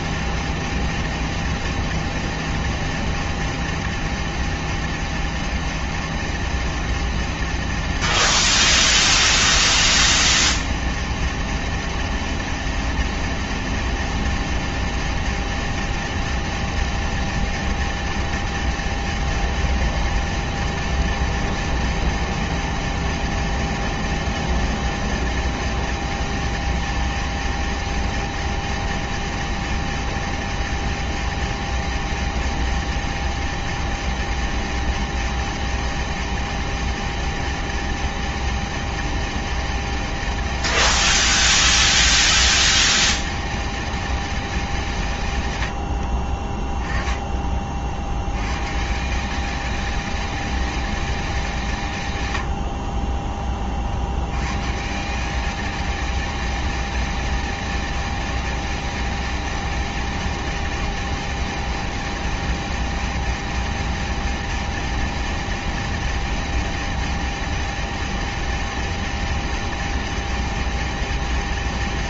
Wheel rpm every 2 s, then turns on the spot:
210, 210, 210, 210, 210, 210, 210, 210, 210, 210, 210, 210, 210, 210, 210, 210, 210, 210, 210, 210, 210, 210, 200, 30, 100, 210, 80, 120, 210, 210, 210, 210, 210, 210, 210, 210.
46-48 52-54